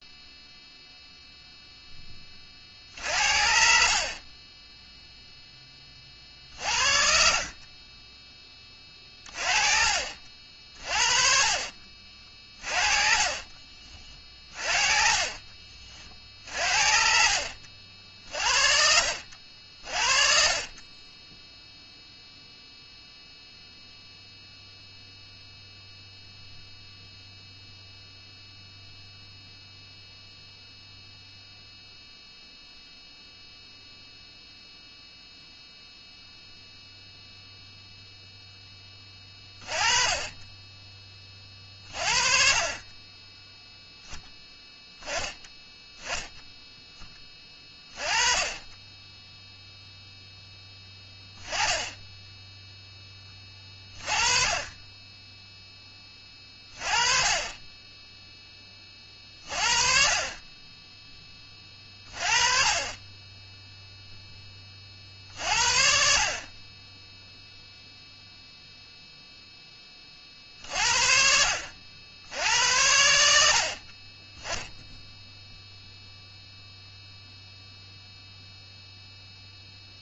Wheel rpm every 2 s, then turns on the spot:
40, 0, 50, 10, 50, 40, 40, 50, 50, 40, 0, 0, 0, 0, 0, 0, 0, 0, 0, 30, 40, 0, 10, 20, 0, 10, 20, 10, 10, 40, 20, 0, 50, 0, 10, 70, 60, 0, 0, 10.
10-16